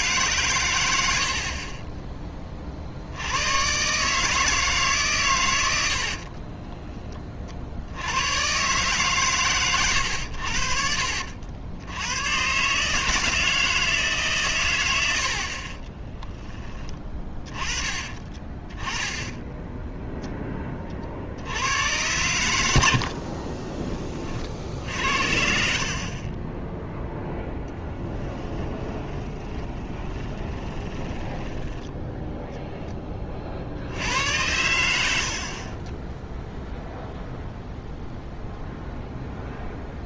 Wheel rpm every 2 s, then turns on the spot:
110, 40, 150, 20, 130, 60, 150, 110, 20, 20, 30, 80, 70, 10, 10, 20, 10, 90, 0, 0.
6-8 22-24 28-32